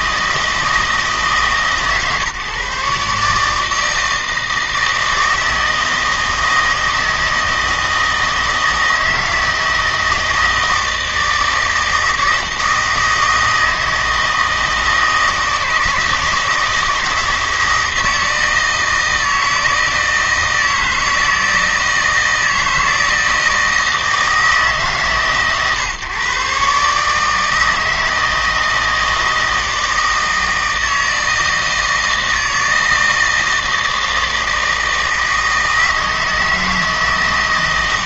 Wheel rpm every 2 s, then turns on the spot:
160, 140, 160, 160, 160, 160, 160, 160, 160, 160, 160, 160, 140, 140, 160, 160, 160, 160, 160.
none